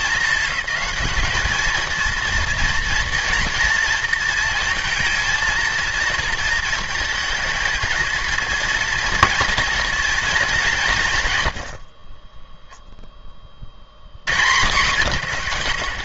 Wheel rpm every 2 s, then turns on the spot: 220, 230, 230, 230, 230, 180, 0, 110.
none